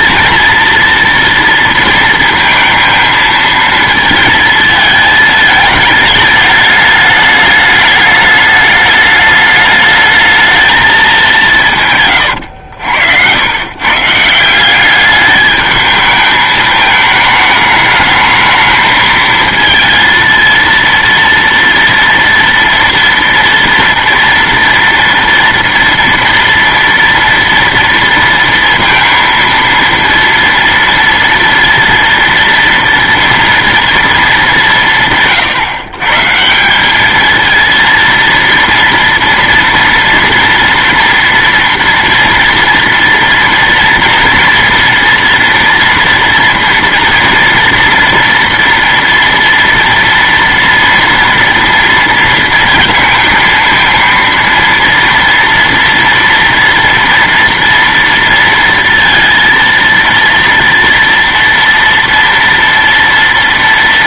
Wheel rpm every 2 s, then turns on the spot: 230, 230, 220, 210, 210, 220, 110, 170, 220, 220, 230, 230, 230, 230, 230, 230, 230, 210, 160, 230, 230, 230, 230, 230, 230, 240, 230, 230, 240, 230, 230, 230.
12-14